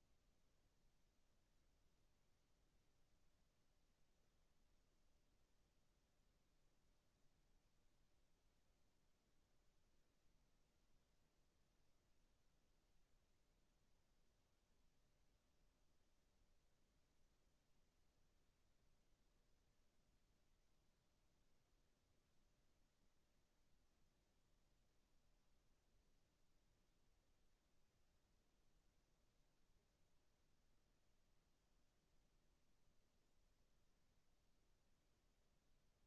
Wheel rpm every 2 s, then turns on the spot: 0, 0, 0, 0, 0, 0, 0, 0, 0, 0, 0, 0, 0, 0, 0, 0, 0, 0.
none